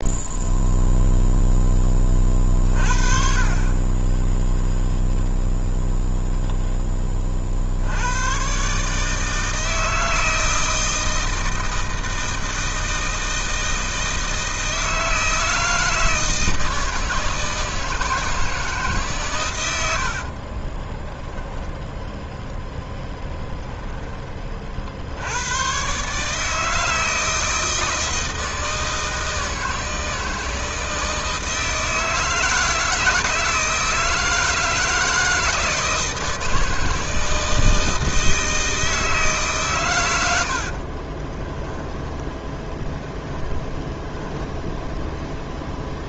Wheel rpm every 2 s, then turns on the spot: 0, 40, 0, 20, 150, 160, 160, 160, 160, 150, 10, 0, 60, 160, 160, 160, 160, 160, 160, 160, 40, 10, 0.
20-22 40-42